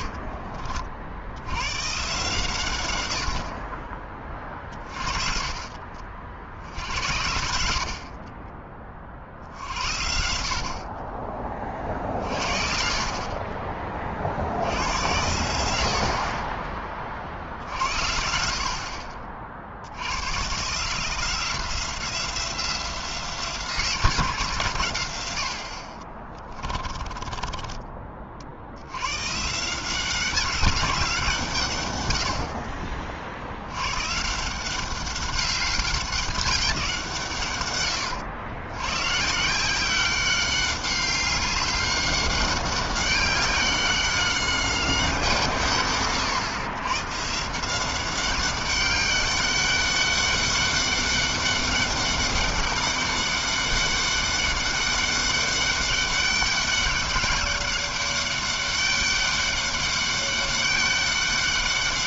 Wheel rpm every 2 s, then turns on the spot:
30, 120, 40, 70, 30, 60, 50, 70, 30, 60, 130, 180, 150, 20, 50, 190, 60, 170, 190, 100, 190, 200, 200, 110, 200, 200, 200, 200, 200, 200, 200.
0-2 4-6 8-12 26-28